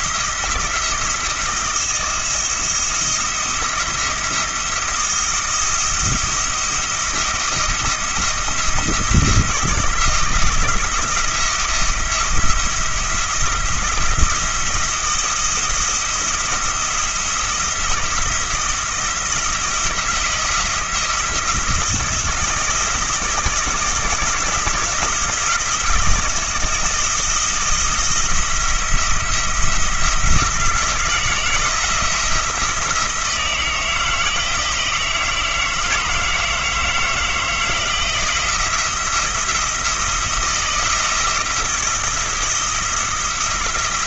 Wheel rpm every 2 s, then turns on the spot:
170, 170, 170, 170, 170, 170, 170, 170, 170, 170, 170, 170, 170, 170, 170, 160, 160, 160, 160, 170, 170, 170.
none